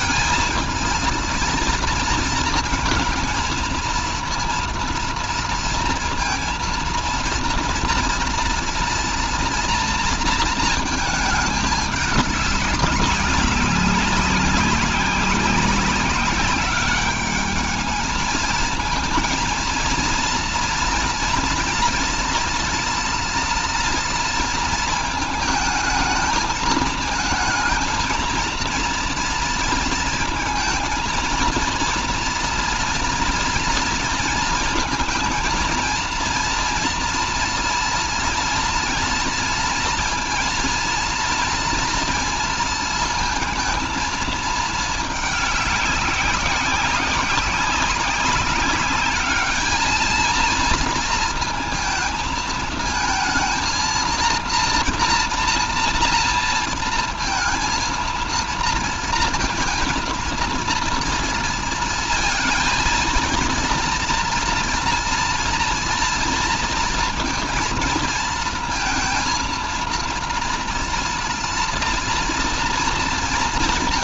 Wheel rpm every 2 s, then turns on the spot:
230, 220, 230, 230, 240, 220, 200, 190, 200, 220, 230, 230, 230, 220, 230, 230, 240, 230, 230, 230, 230, 230, 220, 190, 200, 230, 230, 230, 230, 230, 230, 230, 230, 230, 230, 230, 230.
none